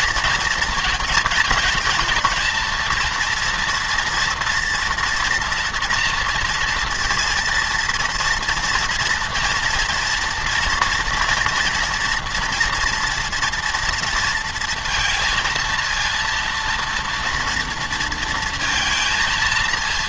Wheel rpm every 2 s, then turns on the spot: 230, 230, 230, 230, 230, 240, 240, 230, 230, 230.
none